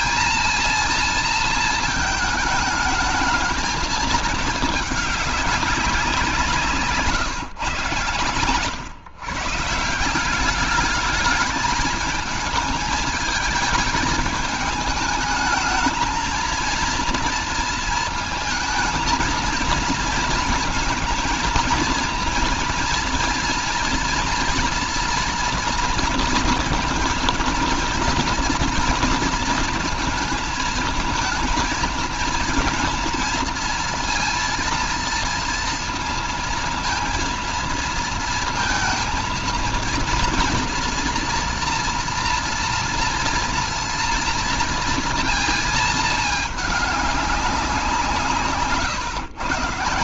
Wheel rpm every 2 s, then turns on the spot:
230, 220, 210, 160, 130, 200, 210, 220, 230, 230, 230, 230, 230, 230, 230, 220, 230, 230, 230, 220, 230, 230, 230, 210, 150.
none